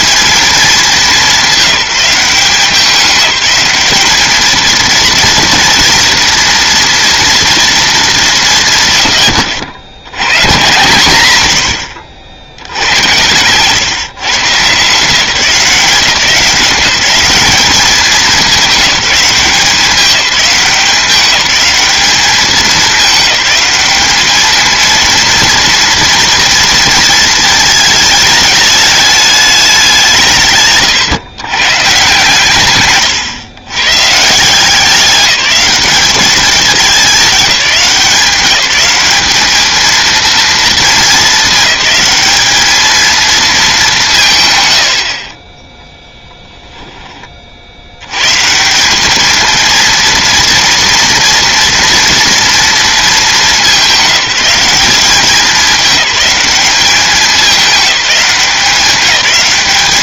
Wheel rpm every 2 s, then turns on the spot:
210, 190, 220, 230, 140, 120, 80, 150, 180, 190, 190, 210, 230, 230, 210, 130, 130, 180, 200, 200, 230, 220, 100, 10, 180, 230, 220, 190, 200, 180.
32-34